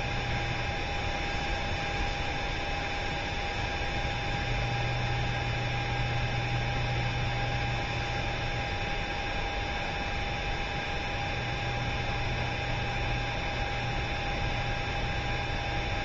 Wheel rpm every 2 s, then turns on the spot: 0, 0, 0, 0, 0, 0, 0, 0.
none